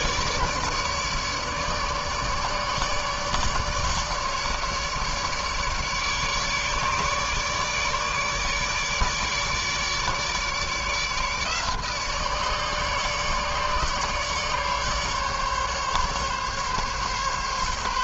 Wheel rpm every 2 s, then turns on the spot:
150, 150, 150, 150, 150, 150, 150, 150, 140.
none